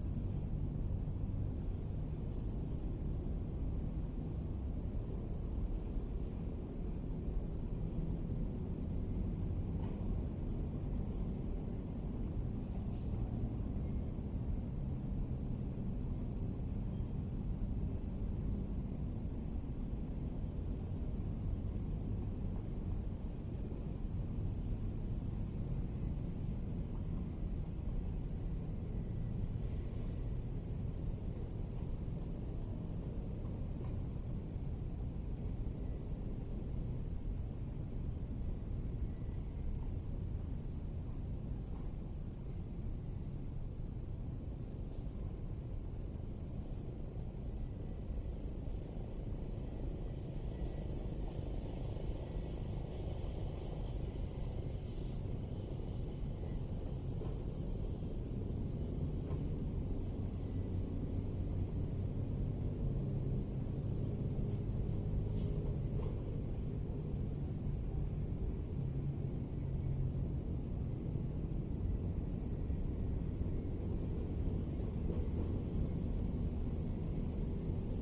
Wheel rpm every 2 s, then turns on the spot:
0, 0, 0, 0, 0, 0, 0, 0, 0, 0, 0, 0, 0, 0, 0, 0, 0, 0, 0, 0, 0, 0, 0, 0, 0, 0, 0, 0, 0, 0, 0, 0, 0, 0, 0, 0, 0, 0, 0.
none